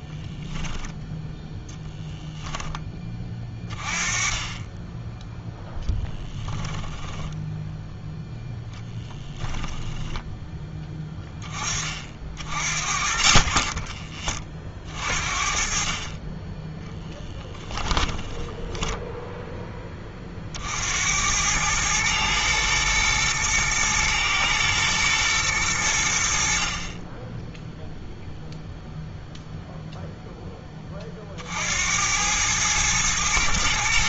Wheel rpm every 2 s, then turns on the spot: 0, 20, 10, 10, 10, 10, 40, 40, 10, 10, 70, 110, 110, 30, 0, 30, 110.
6-10